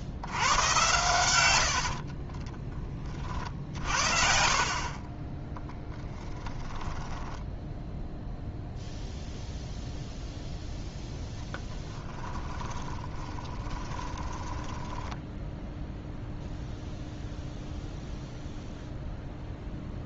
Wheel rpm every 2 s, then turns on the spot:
110, 20, 40, 10, 0, 0, 20, 10, 0, 0.
4-8 12-16